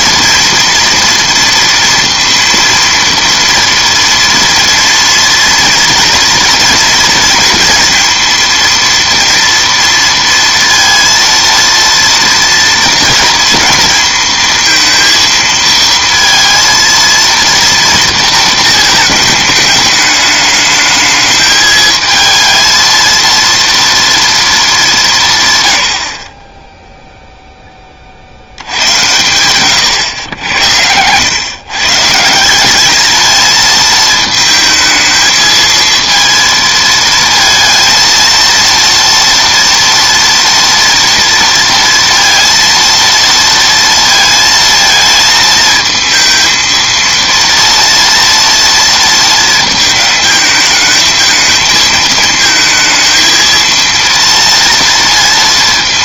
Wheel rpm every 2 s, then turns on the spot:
230, 230, 230, 230, 230, 230, 240, 230, 230, 220, 210, 230, 200, 10, 90, 90, 200, 220, 230, 230, 230, 230, 220, 230, 230, 220, 220, 230.
30-32